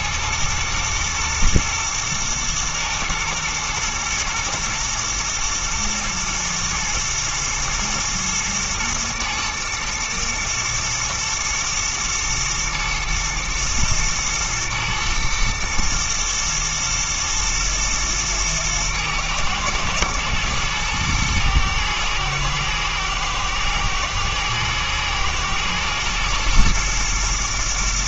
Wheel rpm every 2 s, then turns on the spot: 110, 110, 120, 120, 110, 110, 110, 110, 110, 110, 110, 110, 110, 110.
none